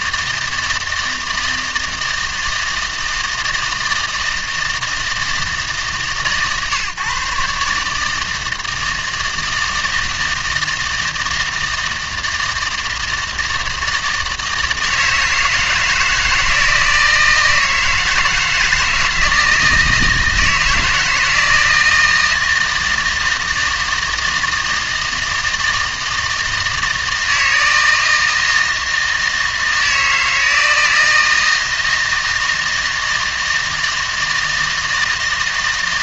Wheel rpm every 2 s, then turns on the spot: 160, 160, 160, 140, 160, 160, 160, 160, 160, 160, 160, 160, 160, 160, 160, 160, 160, 160.
none